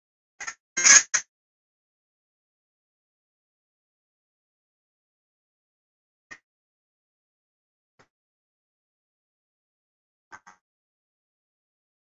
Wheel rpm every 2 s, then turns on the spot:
110, 160, 160, 60, 20, 20.
6-12